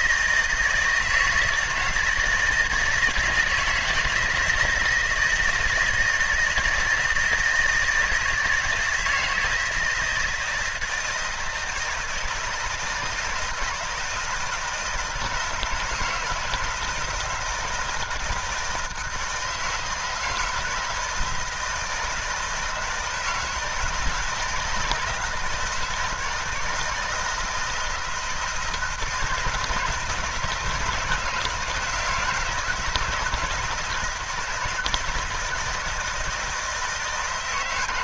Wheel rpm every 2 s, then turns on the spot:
160, 160, 160, 160, 160, 160, 160, 160, 160, 160, 160, 160, 160, 160, 160, 160, 170, 170, 160.
none